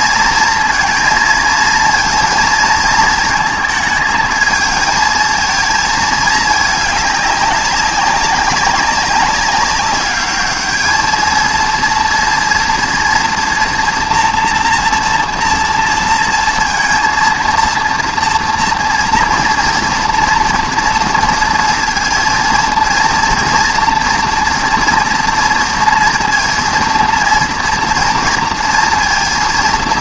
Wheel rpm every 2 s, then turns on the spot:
230, 230, 220, 210, 200, 210, 230, 240, 230, 230, 230, 230, 230, 230, 230.
none